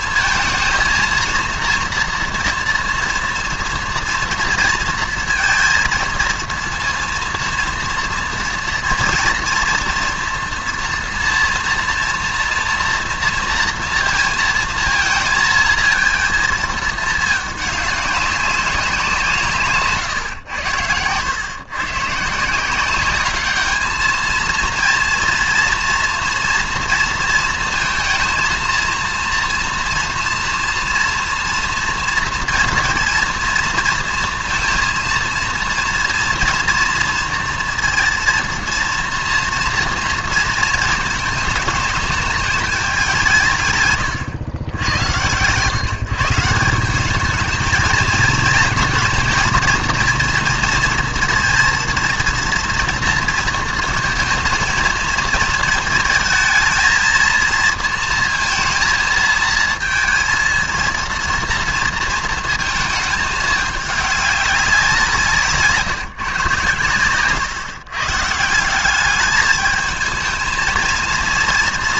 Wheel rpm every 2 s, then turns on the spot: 220, 230, 230, 230, 230, 230, 230, 230, 220, 200, 100, 160, 230, 230, 230, 240, 230, 230, 240, 230, 230, 210, 110, 170, 230, 230, 230, 220, 220, 230, 230, 220, 200, 130, 170, 230.
none